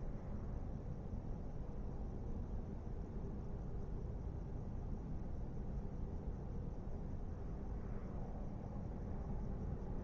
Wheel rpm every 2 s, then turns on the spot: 0, 0, 0, 0, 0.
none